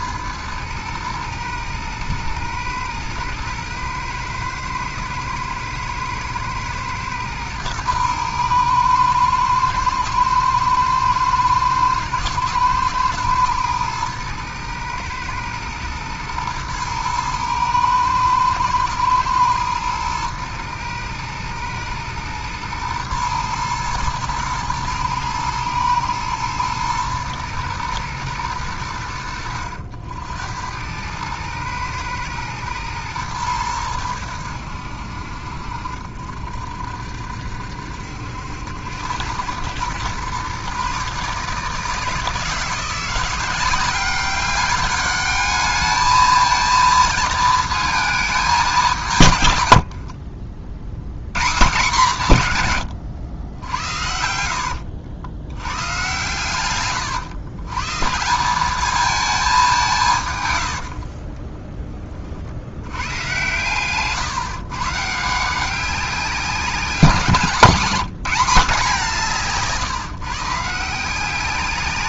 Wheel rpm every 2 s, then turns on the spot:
110, 110, 120, 120, 110, 110, 120, 110, 110, 110, 110, 110, 120, 110, 90, 90, 110, 70, 60, 90, 130, 170, 200, 220, 200, 70, 140, 70, 120, 200, 80, 70, 150, 190, 200, 160.
54-56 60-62